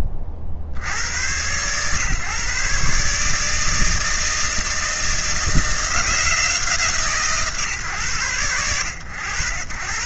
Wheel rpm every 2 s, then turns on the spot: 60, 140, 160, 170, 90.
none